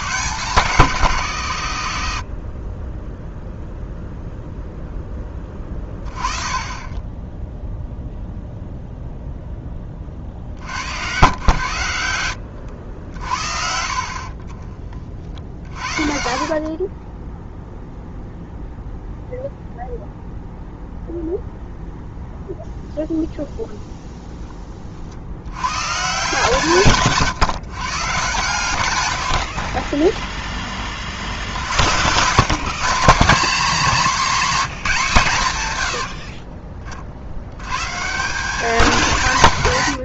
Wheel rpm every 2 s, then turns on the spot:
160, 30, 0, 20, 0, 70, 80, 30, 30, 0, 0, 0, 20, 140, 110, 20, 170, 210, 40, 210.
6-8 12-14 16-18